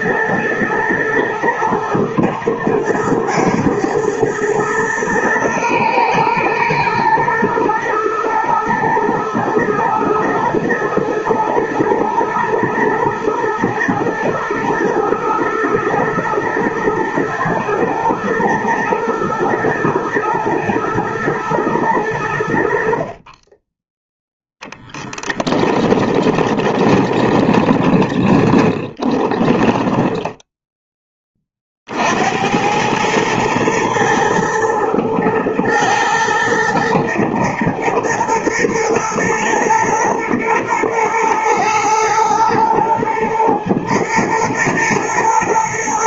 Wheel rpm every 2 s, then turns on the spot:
110, 120, 110, 110, 110, 110, 120, 120, 110, 110, 120, 70, 10, 20, 20, 10, 90, 110, 120, 120, 110, 110, 120.
24-30